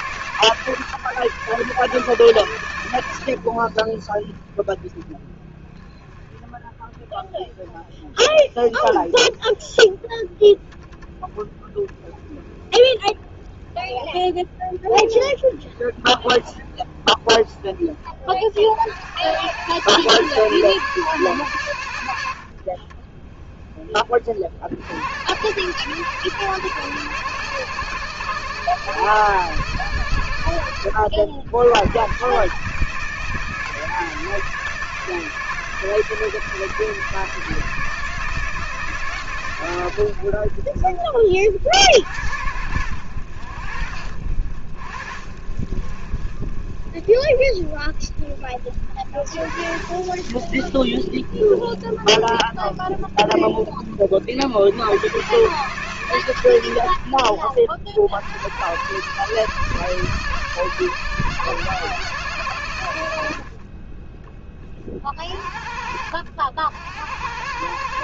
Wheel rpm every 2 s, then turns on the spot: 130, 90, 10, 0, 10, 10, 10, 20, 20, 70, 140, 30, 70, 130, 140, 80, 150, 160, 160, 150, 40, 90, 60, 30, 50, 30, 20, 120, 80, 120, 140, 90, 30, 80.
none